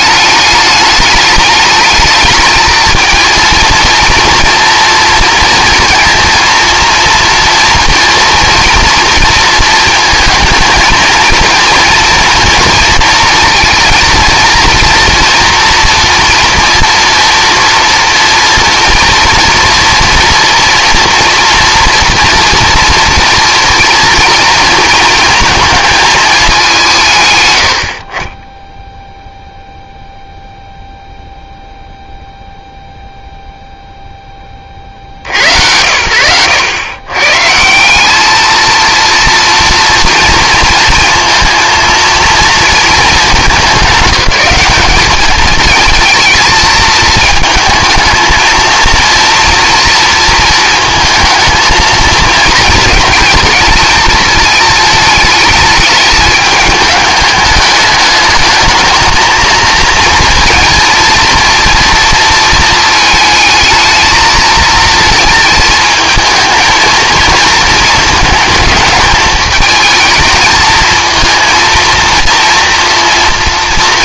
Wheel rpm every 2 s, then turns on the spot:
210, 220, 230, 230, 230, 220, 230, 230, 230, 240, 230, 240, 230, 190, 10, 0, 0, 40, 110, 220, 230, 230, 200, 220, 230, 220, 220, 220, 210, 220, 230, 220, 230, 230, 220, 220, 230.
none